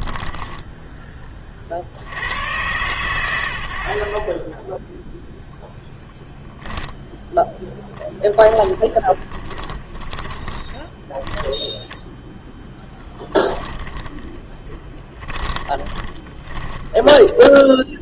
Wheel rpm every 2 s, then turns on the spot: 10, 100, 10, 10, 10, 10, 10, 20, 20.
8-12 14-18